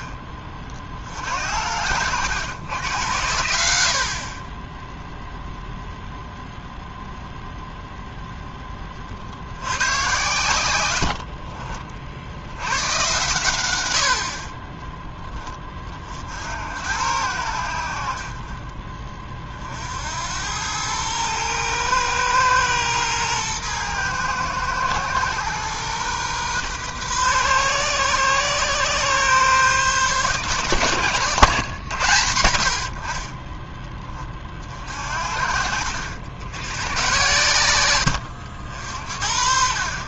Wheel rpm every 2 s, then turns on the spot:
50, 100, 10, 0, 10, 100, 100, 20, 80, 30, 100, 110, 120, 130, 130, 140, 80, 40, 100, 70.
10-12